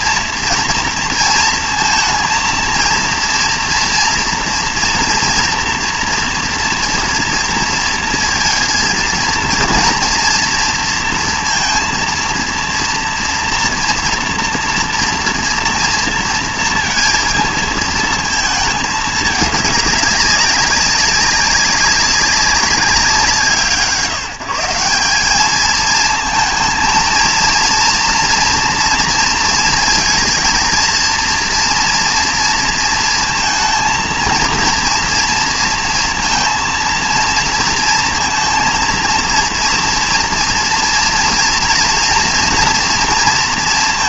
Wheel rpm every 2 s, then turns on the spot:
230, 230, 230, 230, 230, 230, 230, 230, 230, 220, 200, 190, 170, 230, 230, 230, 230, 230, 230, 230, 240, 230.
none